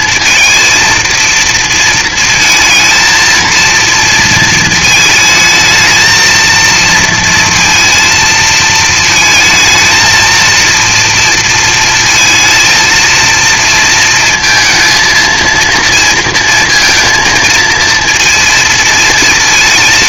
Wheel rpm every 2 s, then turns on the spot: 230, 230, 220, 230, 220, 230, 230, 220, 220, 230.
none